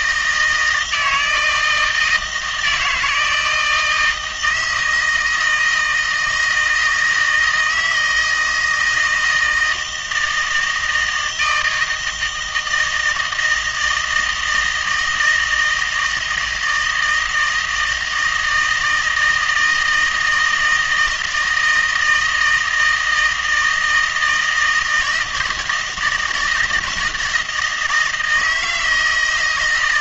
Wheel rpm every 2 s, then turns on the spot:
160, 160, 160, 160, 160, 160, 160, 160, 160, 160, 160, 160, 160, 170, 160.
none